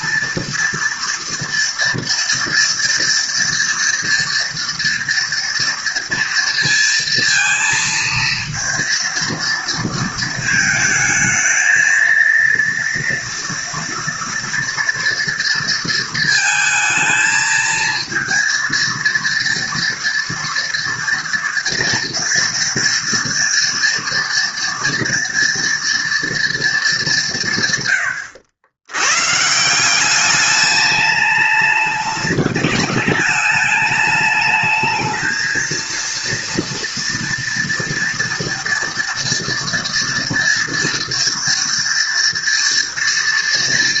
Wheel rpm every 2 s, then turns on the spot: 230, 230, 230, 230, 230, 220, 230, 240, 230, 230, 230, 230, 240, 220, 100, 200, 200, 210, 230, 230, 230, 230.
none